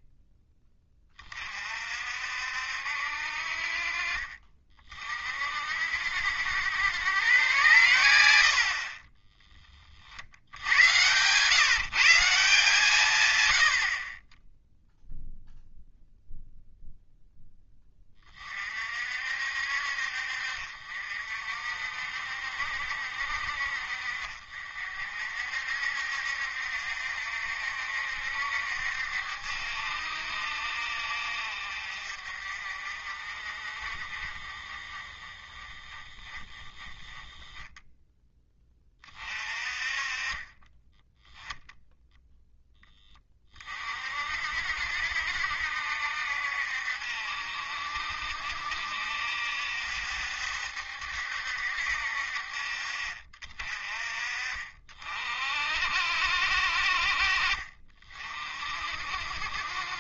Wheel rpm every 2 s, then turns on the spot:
10, 60, 40, 80, 40, 100, 150, 0, 0, 50, 50, 50, 50, 60, 60, 60, 40, 30, 20, 20, 20, 10, 60, 60, 60, 70, 50, 40, 60, 60.
none